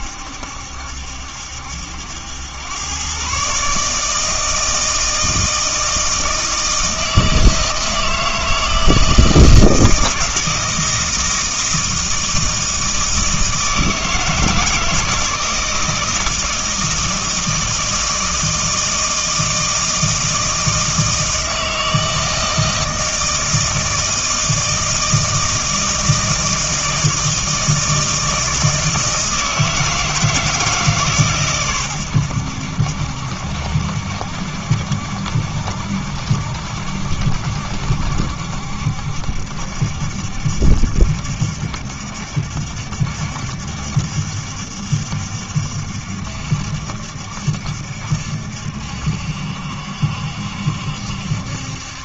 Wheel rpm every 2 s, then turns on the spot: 70, 100, 160, 160, 160, 160, 160, 160, 160, 160, 160, 160, 160, 160, 160, 160, 80, 70, 70, 70, 70, 70, 70, 70, 70, 70.
none